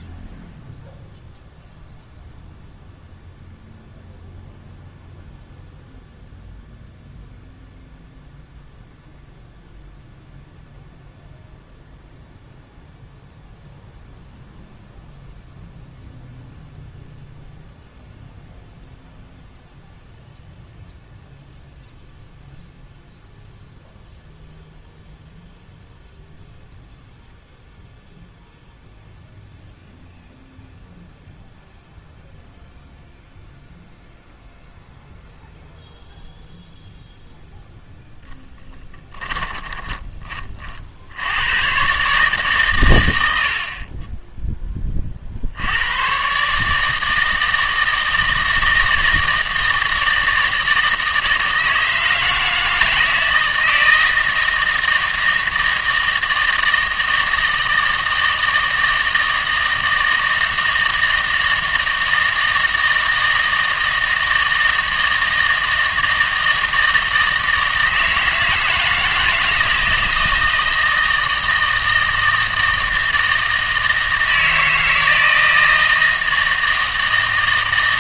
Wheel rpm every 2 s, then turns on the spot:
0, 0, 0, 0, 0, 0, 0, 0, 0, 0, 0, 0, 0, 0, 0, 0, 0, 0, 0, 10, 50, 130, 20, 150, 160, 160, 160, 160, 160, 160, 160, 160, 160, 160, 160, 160, 160, 160, 160.
38-40